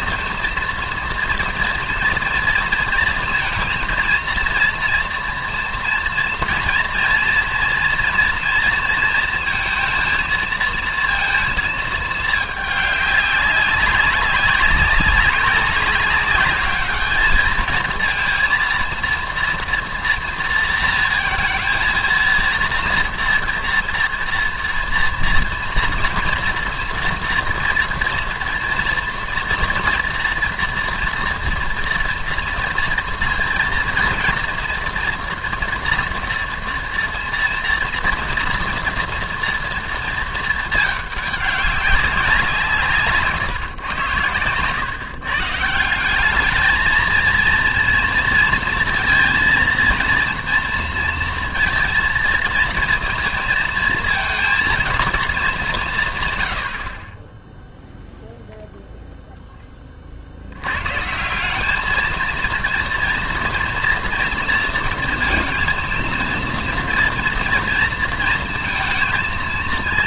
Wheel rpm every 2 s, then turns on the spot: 230, 230, 230, 230, 230, 230, 210, 200, 210, 230, 230, 230, 230, 230, 230, 240, 230, 230, 230, 230, 220, 170, 110, 210, 230, 230, 230, 230, 80, 0, 90, 230, 230, 240, 230.
none